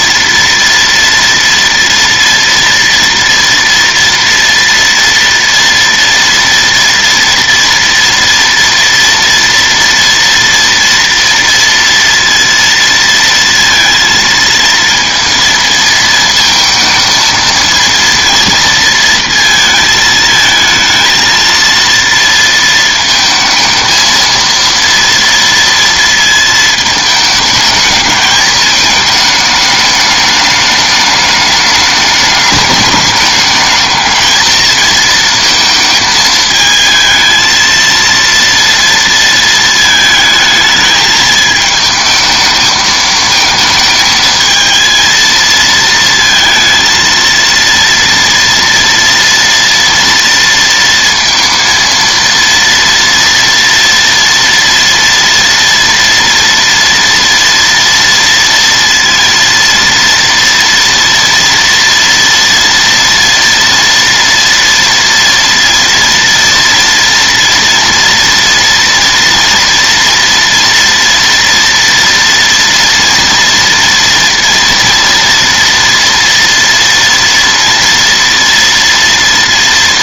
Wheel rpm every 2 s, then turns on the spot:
230, 230, 230, 230, 230, 230, 230, 230, 220, 230, 220, 230, 230, 220, 220, 210, 210, 220, 220, 230, 220, 220, 220, 230, 230, 230, 230, 230, 230, 230, 230, 230, 230, 230, 230, 230, 230, 230, 230, 230.
none